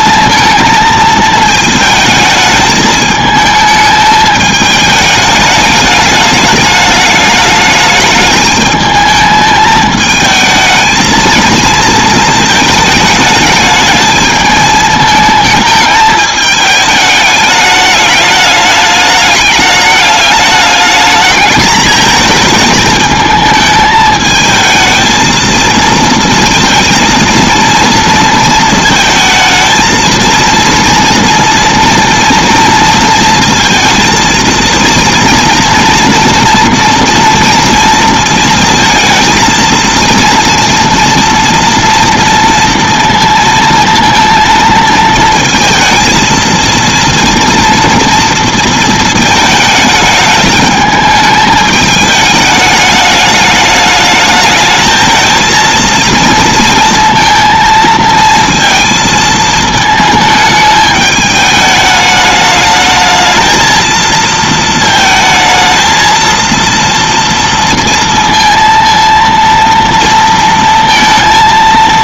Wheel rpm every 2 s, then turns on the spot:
220, 220, 210, 210, 210, 220, 220, 220, 210, 210, 210, 220, 220, 230, 230, 230, 230, 230, 230, 230, 230, 230, 230, 230, 230, 210, 210, 220, 230, 230, 220, 210, 230, 230, 230, 230.
none